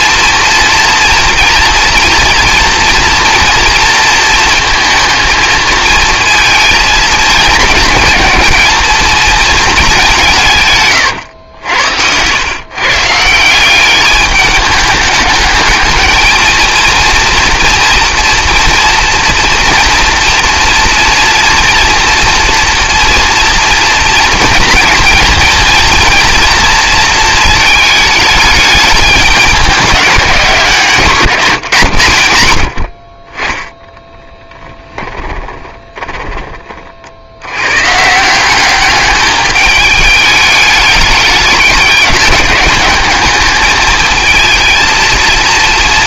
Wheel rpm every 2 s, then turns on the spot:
240, 230, 230, 220, 220, 130, 130, 210, 230, 230, 230, 230, 230, 230, 210, 170, 60, 10, 50, 190, 210, 200, 230.
10-12 34-36